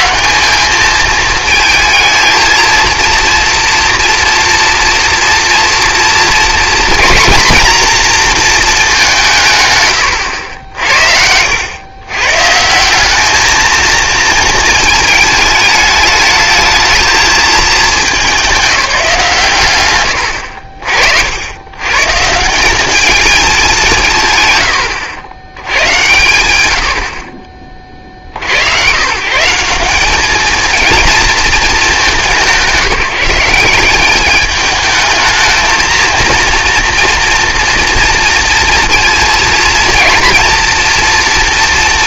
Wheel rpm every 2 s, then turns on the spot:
210, 230, 230, 230, 230, 70, 160, 220, 220, 180, 70, 190, 130, 70, 100, 220, 170, 220, 230, 230, 230.
none